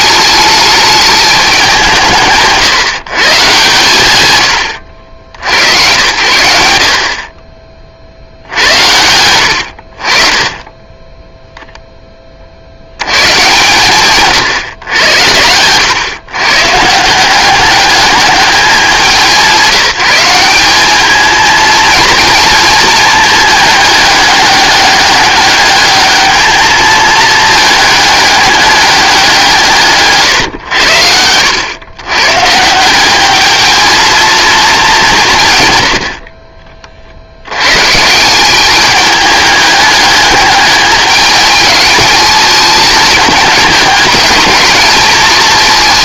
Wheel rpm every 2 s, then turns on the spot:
210, 150, 90, 80, 80, 20, 70, 120, 140, 210, 200, 220, 200, 220, 200, 110, 170, 220, 40, 200, 210, 210, 210.
none